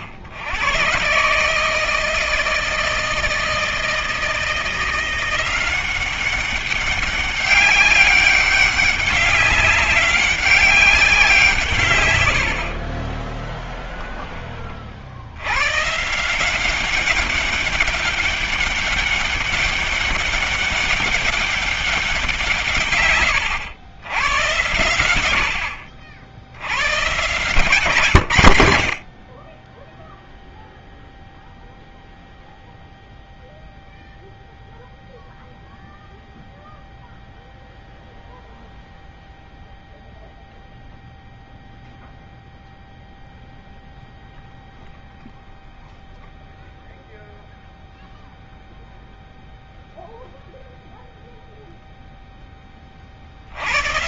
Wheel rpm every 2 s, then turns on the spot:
90, 160, 160, 190, 200, 200, 100, 20, 160, 200, 200, 160, 100, 80, 130, 0, 0, 0, 0, 0, 0, 0, 0, 0, 0, 0, 10.
none